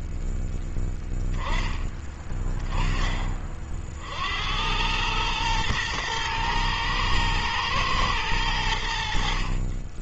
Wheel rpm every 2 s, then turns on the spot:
10, 20, 100, 120, 70.
none